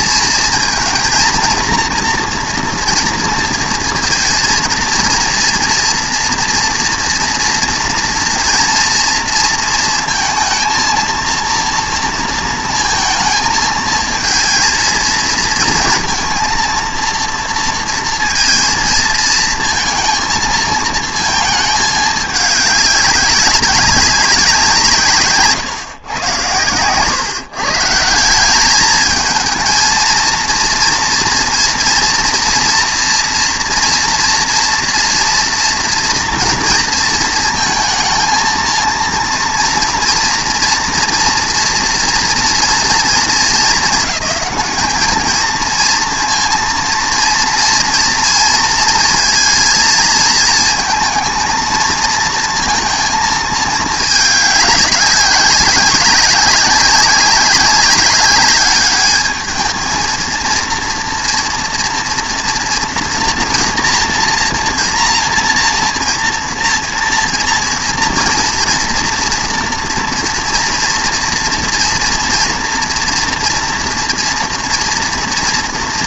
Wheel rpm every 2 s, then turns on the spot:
230, 230, 230, 240, 230, 230, 230, 230, 230, 230, 220, 200, 170, 110, 200, 230, 240, 230, 230, 230, 230, 230, 210, 230, 230, 220, 230, 200, 190, 210, 230, 230, 240, 230, 230, 230, 240, 230.
none